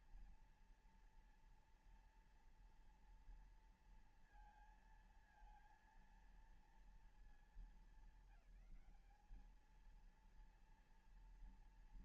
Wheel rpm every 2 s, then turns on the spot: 230, 230, 230, 230, 190, 230.
none